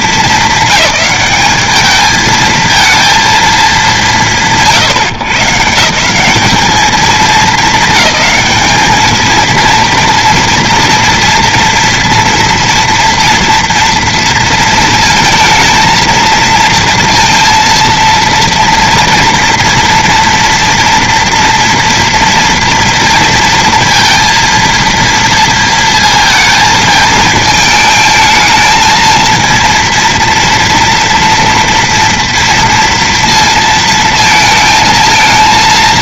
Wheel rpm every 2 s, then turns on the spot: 210, 230, 160, 200, 210, 230, 230, 230, 230, 230, 230, 230, 230, 230, 220, 230, 230, 230.
none